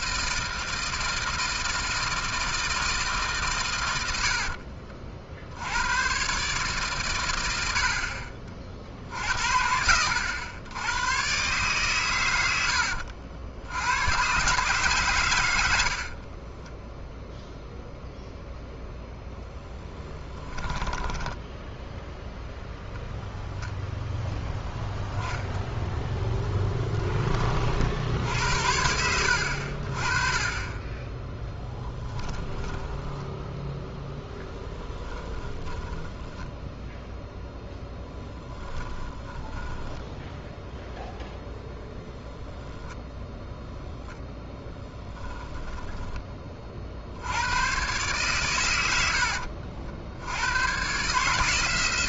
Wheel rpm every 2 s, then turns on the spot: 160, 160, 60, 140, 50, 100, 90, 130, 30, 0, 10, 0, 10, 20, 70, 30, 10, 10, 0, 10, 0, 0, 10, 40, 110, 100.
4-6 16-18 20-22 26-28 32-34 38-40 44-46